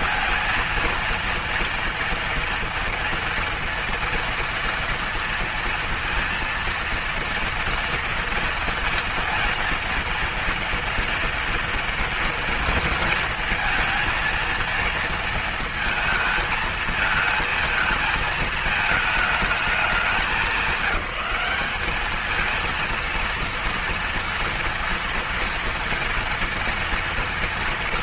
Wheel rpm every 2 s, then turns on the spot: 230, 230, 230, 230, 230, 230, 230, 230, 220, 220, 200, 220, 230, 230.
none